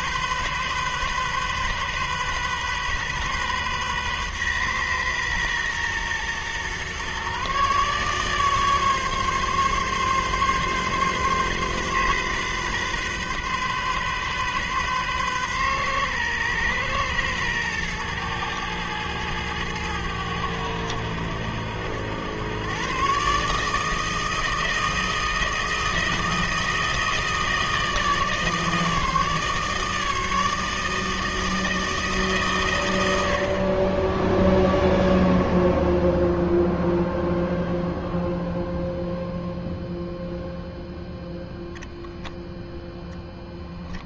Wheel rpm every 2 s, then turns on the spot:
130, 130, 130, 120, 140, 140, 130, 130, 120, 110, 90, 110, 160, 160, 160, 160, 130, 0, 0, 0, 0, 10.
none